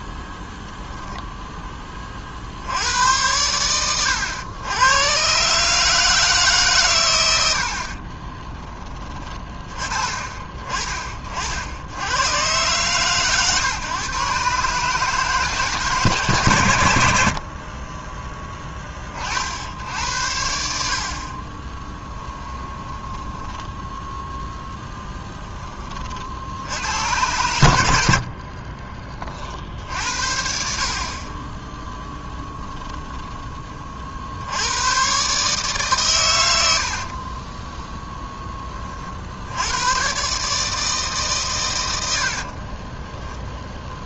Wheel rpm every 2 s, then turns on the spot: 10, 110, 130, 90, 20, 50, 130, 160, 50, 60, 40, 10, 20, 100, 10, 60, 20, 90, 90, 10, 150, 50.
16-18 22-24 32-34 42-44